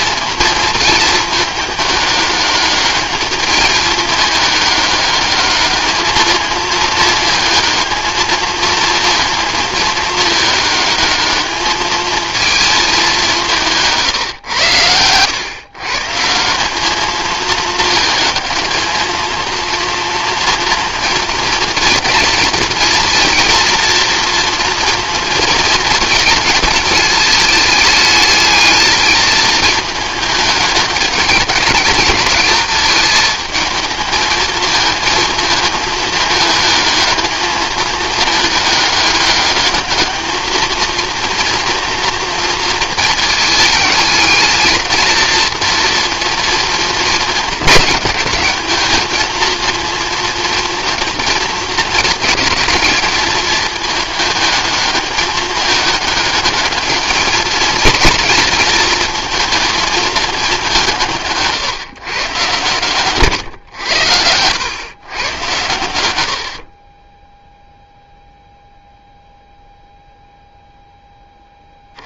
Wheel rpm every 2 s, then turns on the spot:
230, 210, 210, 220, 220, 210, 210, 110, 200, 220, 230, 230, 230, 220, 220, 210, 220, 220, 220, 210, 230, 230, 220, 230, 210, 220, 220, 210, 210, 220, 180, 130, 100, 40, 0, 0.
none